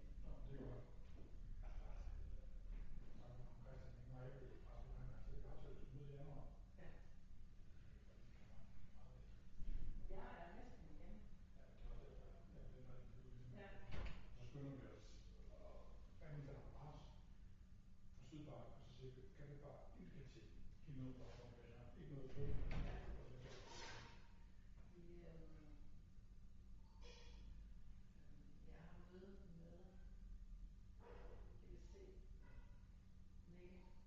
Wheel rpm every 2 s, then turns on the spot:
0, 0, 0, 0, 0, 0, 0, 0, 0, 0, 0, 0, 0, 0, 0, 0, 0.
none